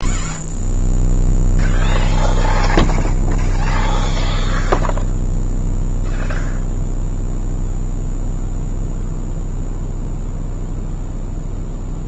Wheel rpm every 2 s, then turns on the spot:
0, 0, 0, 0, 0, 0.
none